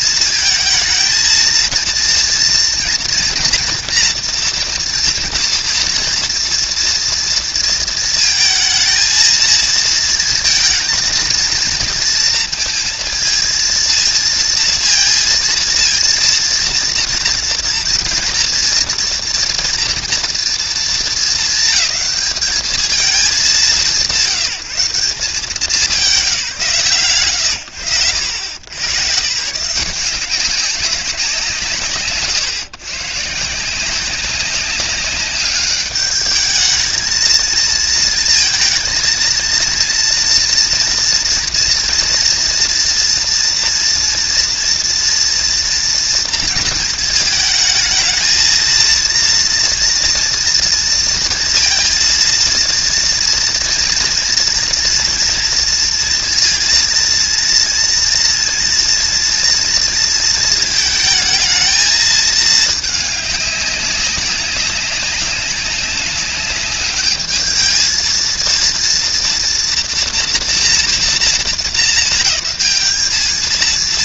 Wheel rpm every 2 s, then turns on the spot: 220, 230, 230, 230, 220, 230, 230, 230, 230, 230, 210, 200, 170, 160, 90, 180, 130, 190, 220, 230, 230, 230, 230, 230, 220, 230, 230, 230, 230, 230, 220, 220, 200, 200, 230, 240, 210.
none